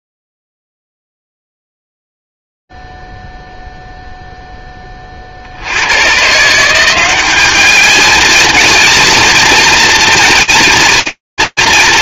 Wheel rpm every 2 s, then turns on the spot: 10, 0, 0, 70, 210, 230.
none